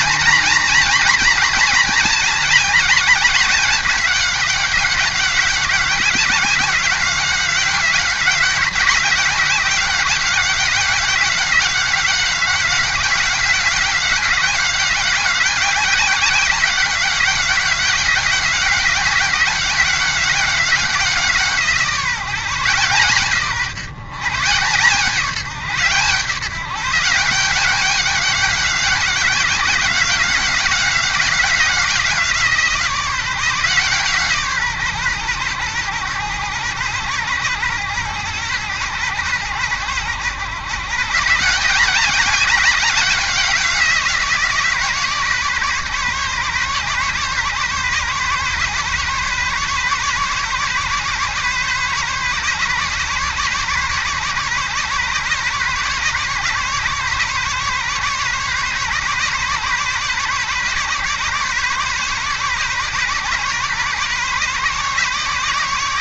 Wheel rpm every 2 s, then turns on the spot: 230, 210, 190, 190, 190, 190, 190, 190, 190, 180, 180, 160, 140, 160, 190, 180, 170, 150, 110, 110, 110, 190, 170, 140, 140, 140, 140, 130, 140, 130, 140, 140, 140.
none